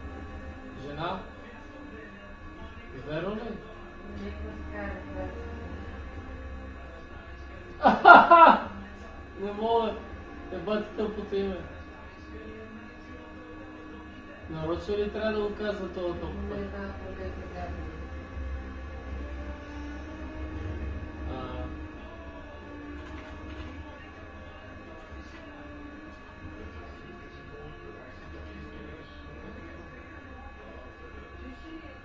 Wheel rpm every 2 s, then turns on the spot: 0, 0, 0, 0, 0, 0, 0, 0, 0, 0, 0, 0, 0, 0, 0, 0.
none